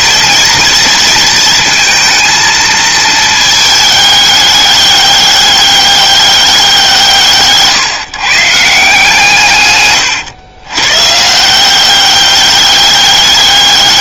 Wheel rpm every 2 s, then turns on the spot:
230, 220, 200, 160, 160, 140, 210.
none